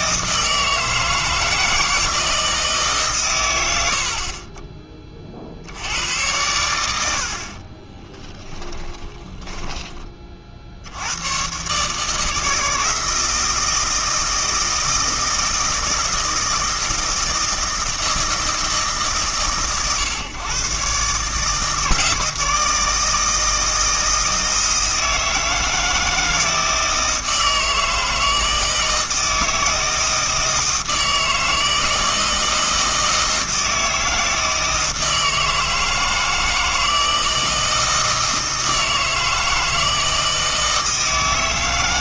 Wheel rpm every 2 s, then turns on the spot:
160, 150, 20, 100, 20, 70, 160, 160, 160, 160, 130, 160, 170, 160, 160, 160, 160, 160, 160, 160, 160.
8-10